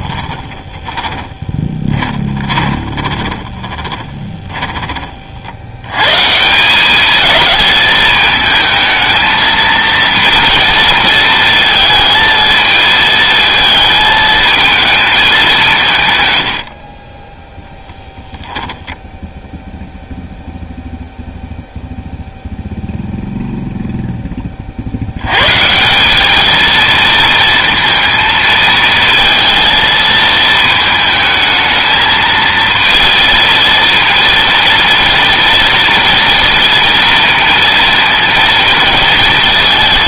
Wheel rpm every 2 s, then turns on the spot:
10, 20, 30, 190, 220, 230, 220, 220, 40, 10, 0, 0, 60, 230, 230, 220, 230, 230, 230, 230.
0-4